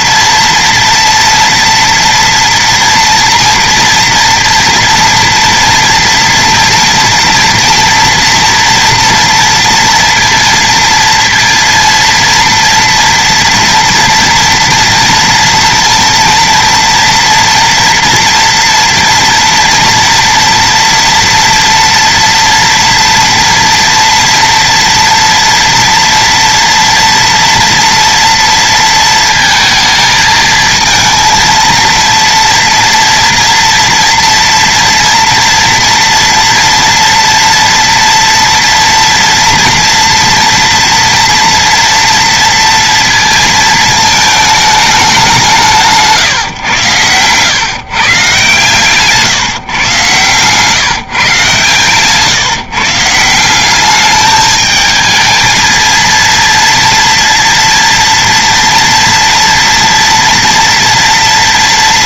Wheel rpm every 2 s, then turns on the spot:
230, 230, 230, 230, 230, 230, 230, 230, 230, 240, 230, 230, 230, 230, 230, 220, 230, 230, 230, 230, 230, 230, 210, 120, 140, 150, 150, 220, 230, 230, 230.
none